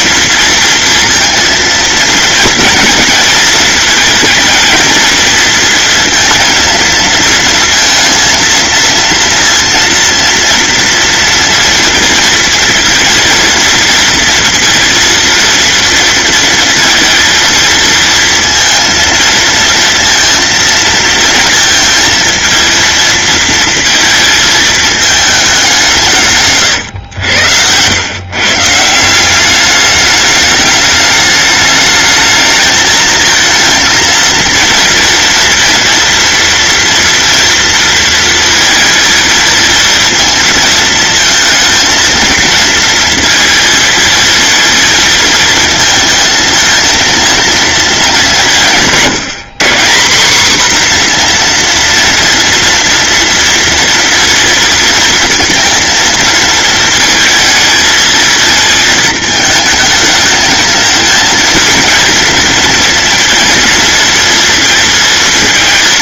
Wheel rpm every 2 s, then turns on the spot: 230, 230, 230, 230, 230, 230, 230, 230, 230, 230, 230, 230, 220, 120, 170, 210, 220, 230, 230, 230, 230, 230, 220, 230, 170, 250, 230, 230, 230, 220, 220, 230, 230.
none